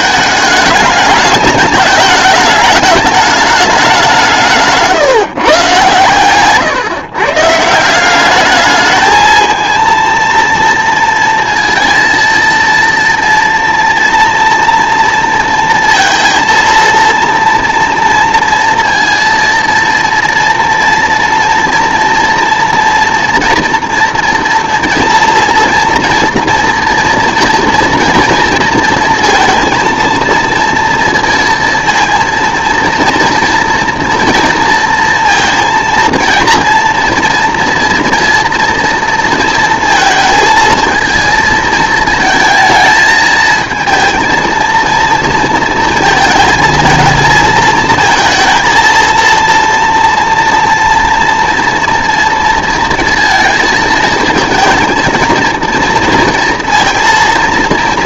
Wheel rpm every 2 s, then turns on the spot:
210, 220, 160, 130, 210, 230, 230, 230, 230, 230, 230, 230, 230, 230, 230, 230, 230, 230, 230, 230, 220, 220, 230, 220, 230, 230, 230, 220, 230.
none